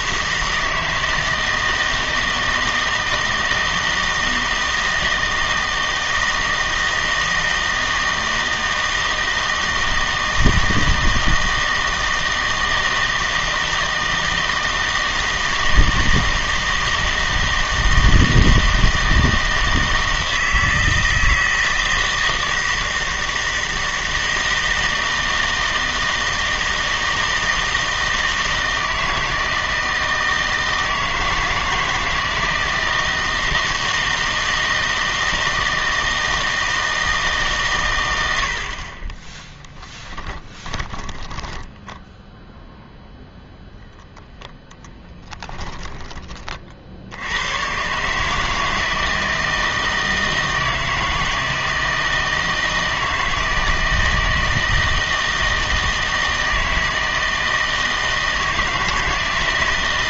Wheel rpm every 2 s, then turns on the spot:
160, 160, 160, 160, 160, 160, 160, 160, 160, 160, 160, 160, 160, 160, 160, 160, 160, 160, 160, 60, 20, 0, 10, 50, 160, 160, 160, 160, 160, 160.
40-42